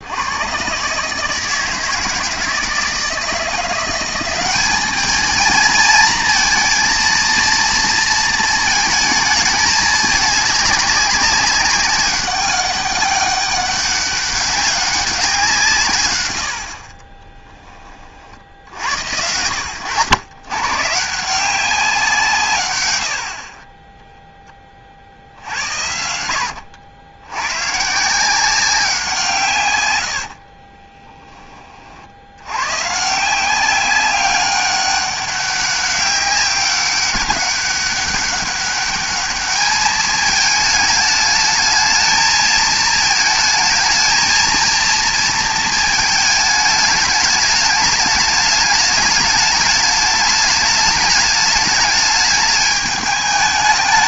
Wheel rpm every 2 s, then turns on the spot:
130, 160, 200, 230, 220, 200, 190, 200, 70, 80, 140, 130, 20, 90, 180, 30, 120, 200, 190, 200, 220, 220, 230, 210, 210, 210, 210.
16-18 26-28 30-32